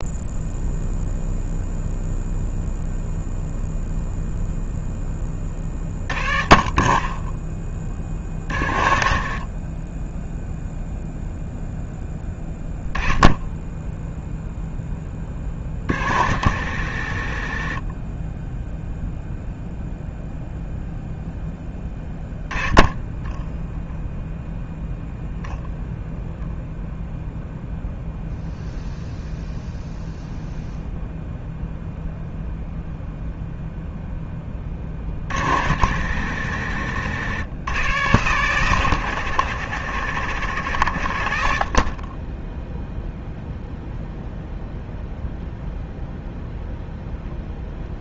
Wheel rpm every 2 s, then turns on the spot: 0, 0, 0, 30, 60, 0, 10, 0, 100, 0, 0, 10, 0, 0, 0, 0, 0, 40, 110, 110, 80, 0, 0, 0.
none